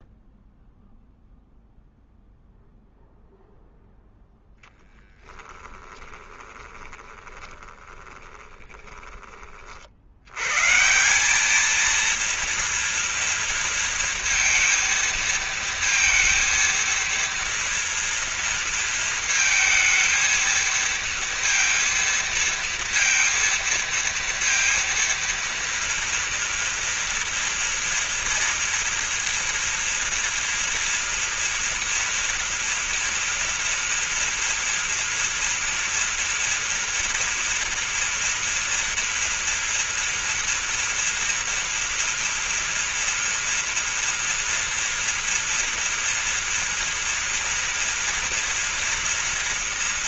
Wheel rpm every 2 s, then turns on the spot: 0, 0, 0, 20, 20, 160, 230, 230, 230, 230, 230, 230, 230, 230, 240, 230, 230, 230, 230, 230, 230, 230, 230, 230, 240.
6-10